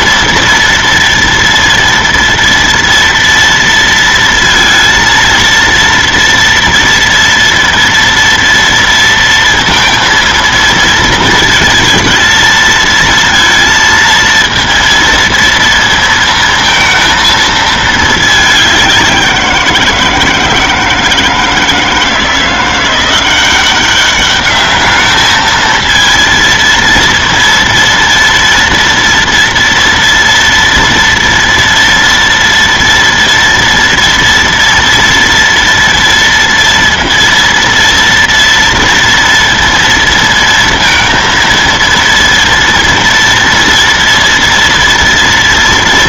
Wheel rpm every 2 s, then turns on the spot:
230, 230, 230, 230, 230, 230, 230, 230, 230, 200, 160, 170, 210, 230, 230, 230, 230, 230, 230, 230, 230, 230, 230.
none